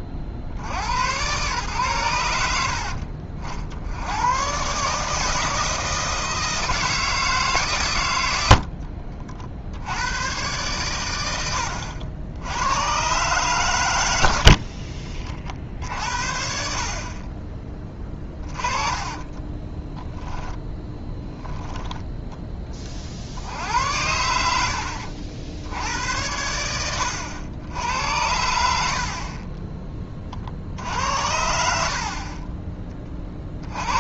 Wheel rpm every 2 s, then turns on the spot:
40, 60, 120, 160, 70, 110, 90, 60, 60, 20, 10, 20, 100, 90, 80, 40, 30.
14-16 18-20